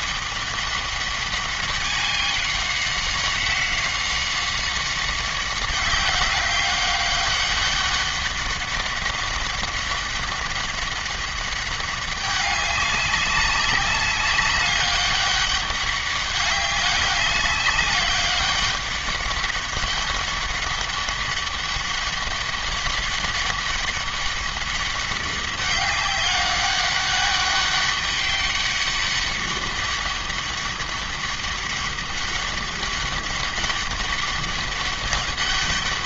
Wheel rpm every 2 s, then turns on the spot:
200, 190, 190, 200, 200, 200, 200, 200, 200, 200, 200, 200, 200, 200, 200, 200, 200, 200.
none